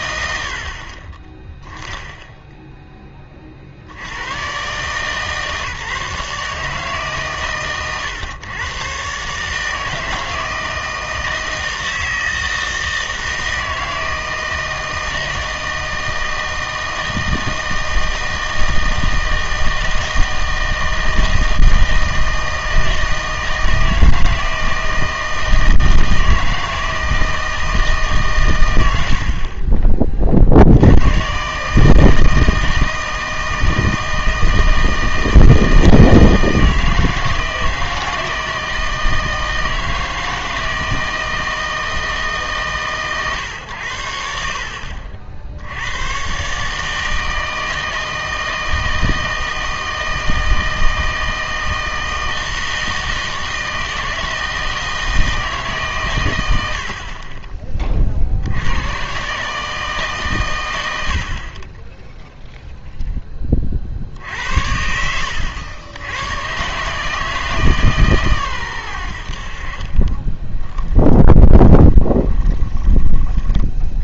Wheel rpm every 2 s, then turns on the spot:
50, 0, 130, 150, 120, 160, 160, 160, 160, 160, 160, 160, 160, 160, 100, 70, 160, 160, 160, 160, 160, 140, 60, 140, 160, 160, 160, 160, 90, 80, 100, 0, 80, 120, 110, 20, 20.
70-74